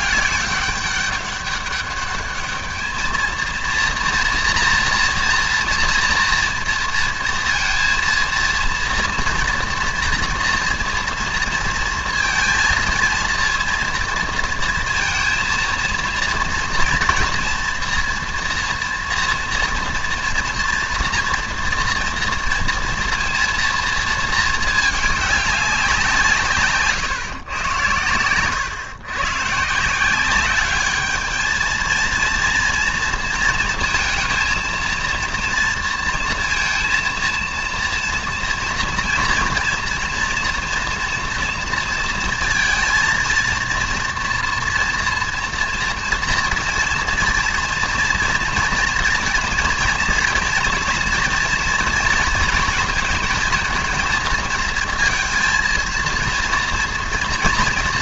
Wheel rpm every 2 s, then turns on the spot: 200, 210, 230, 230, 230, 230, 230, 230, 240, 230, 230, 230, 220, 140, 120, 200, 230, 230, 230, 230, 230, 230, 240, 240, 230, 230, 230, 220, 230.
none